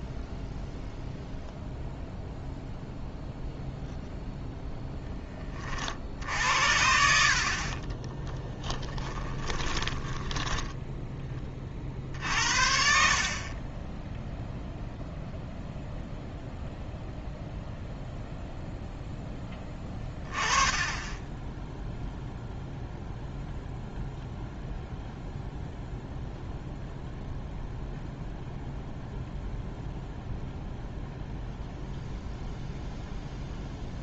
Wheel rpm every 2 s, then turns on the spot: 0, 0, 0, 60, 10, 10, 60, 0, 0, 0, 20, 0, 0, 0, 0, 0, 0.
8-12